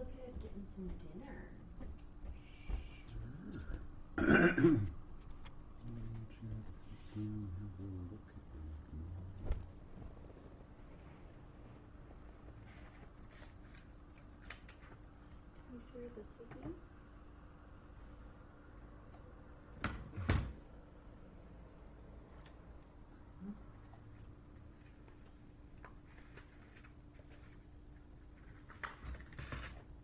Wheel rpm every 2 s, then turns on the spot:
0, 0, 0, 0, 0, 0, 0, 0, 0, 0, 0, 0, 0, 0, 0.
none